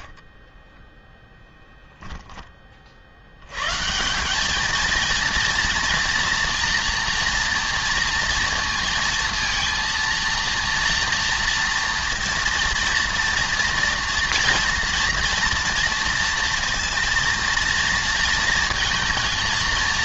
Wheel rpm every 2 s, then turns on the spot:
0, 100, 230, 230, 230, 230, 230, 230, 230, 230.
none